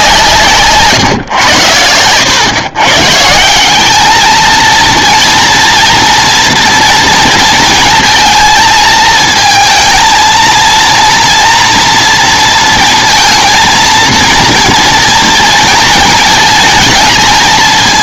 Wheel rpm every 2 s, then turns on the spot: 150, 130, 230, 240, 220, 230, 230, 230, 220.
none